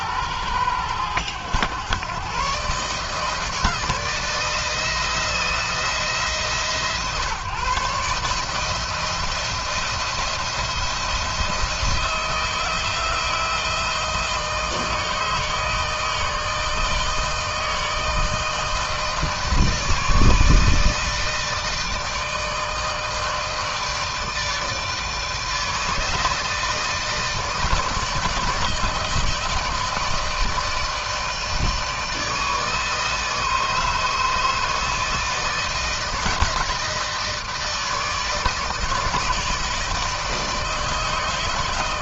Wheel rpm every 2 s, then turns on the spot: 100, 130, 160, 140, 150, 170, 160, 160, 160, 160, 160, 160, 160, 160, 150, 160, 160, 160, 160, 160, 160.
none